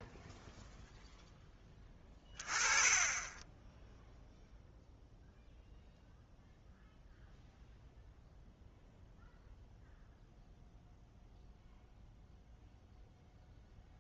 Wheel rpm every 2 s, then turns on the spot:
0, 20, 0, 0, 0, 0, 0.
none